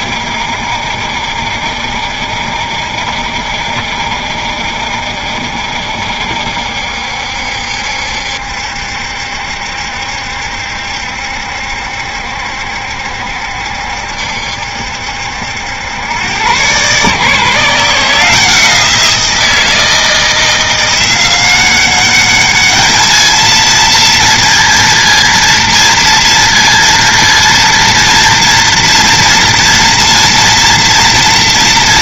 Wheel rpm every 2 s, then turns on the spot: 70, 70, 70, 70, 70, 70, 70, 70, 120, 170, 170, 210, 230, 230, 230, 230.
none